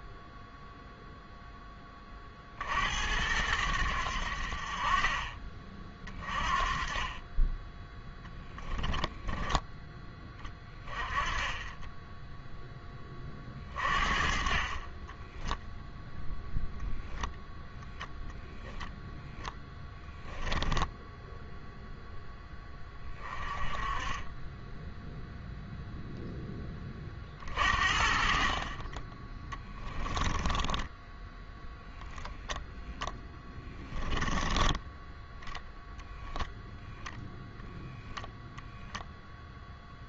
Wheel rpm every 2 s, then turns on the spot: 0, 60, 50, 30, 10, 20, 0, 40, 10, 0, 10, 10, 10, 20, 40, 10, 0, 10, 10, 0.
8-10 20-22 30-32 34-36